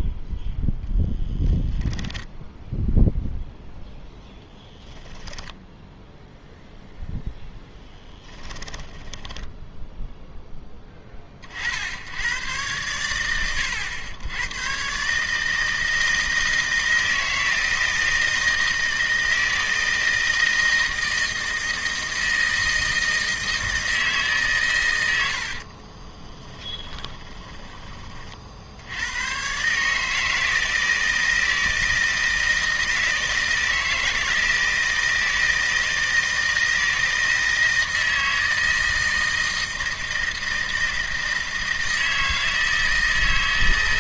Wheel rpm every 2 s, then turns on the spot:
0, 0, 0, 0, 10, 20, 90, 120, 160, 160, 160, 160, 120, 10, 70, 160, 160, 160, 160, 160, 160, 160.
8-10 26-28